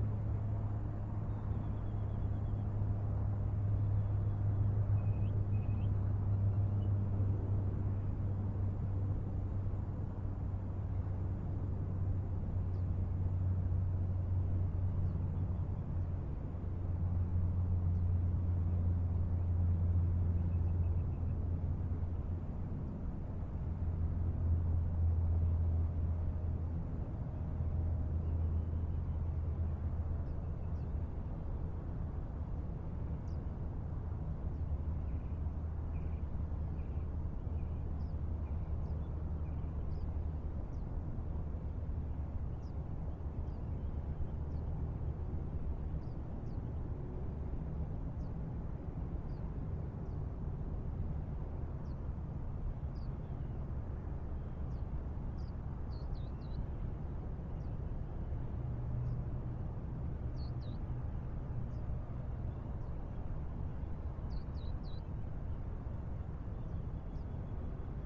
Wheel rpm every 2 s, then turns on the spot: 0, 0, 0, 0, 0, 0, 0, 0, 0, 0, 0, 0, 0, 0, 0, 0, 0, 0, 0, 0, 0, 0, 0, 0, 0, 0, 0, 0, 0, 0, 0, 0, 0, 0.
none